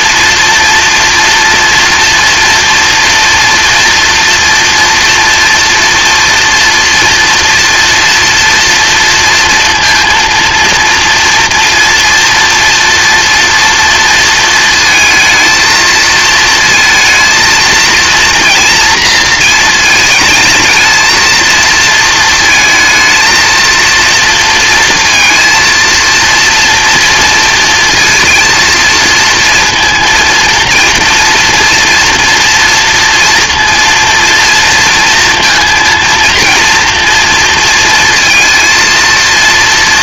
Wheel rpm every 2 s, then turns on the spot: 230, 240, 230, 230, 230, 230, 230, 220, 230, 230, 220, 220, 230, 230, 230, 230, 230, 230, 230, 230.
none